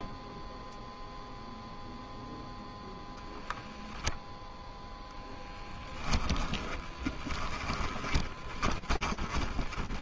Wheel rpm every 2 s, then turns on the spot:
0, 0, 10, 10, 30.
6-10